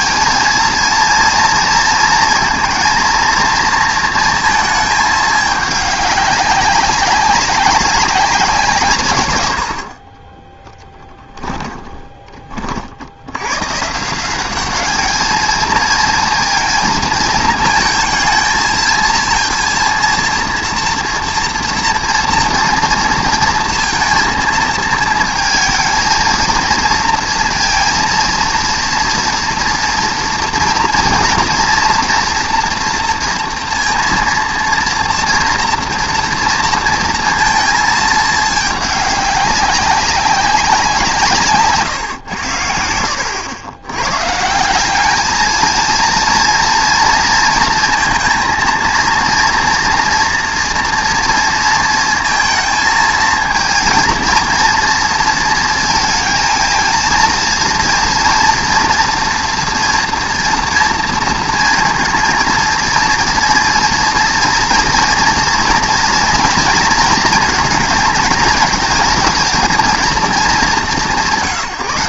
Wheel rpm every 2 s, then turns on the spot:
230, 230, 220, 200, 170, 10, 40, 200, 230, 230, 230, 230, 230, 230, 230, 230, 230, 230, 230, 210, 190, 90, 170, 230, 230, 230, 230, 230, 230, 230, 230, 230, 230, 230, 220, 190.
10-12